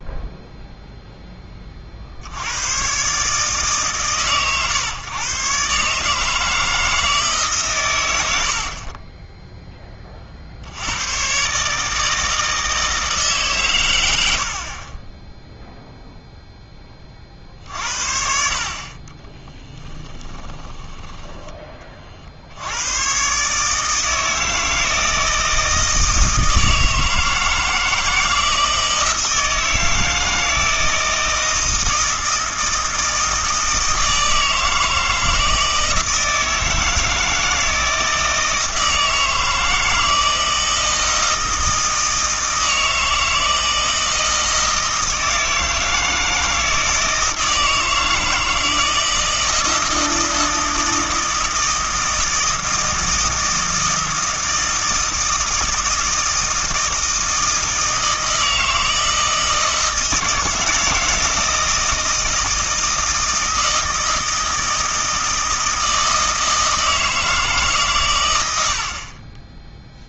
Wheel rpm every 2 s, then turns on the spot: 0, 110, 130, 160, 50, 80, 160, 30, 10, 40, 20, 90, 160, 160, 160, 160, 160, 160, 160, 160, 160, 160, 160, 160, 160, 160, 160, 160, 160, 160, 160, 160, 160, 160, 70.
8-10 14-16 20-22